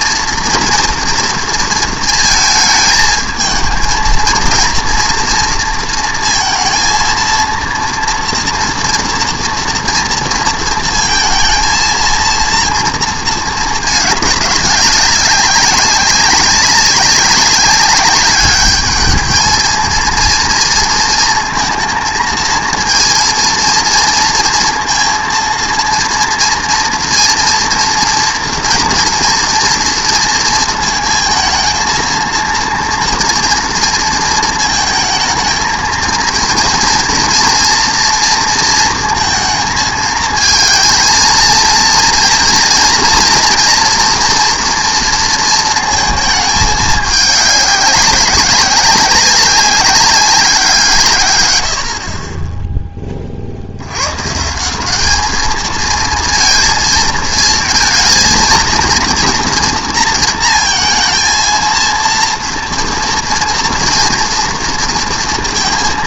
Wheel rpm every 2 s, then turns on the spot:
230, 220, 230, 230, 240, 230, 230, 200, 190, 210, 230, 230, 230, 230, 230, 230, 230, 220, 230, 230, 230, 230, 230, 220, 200, 170, 10, 170, 230, 230, 230, 230, 230.
none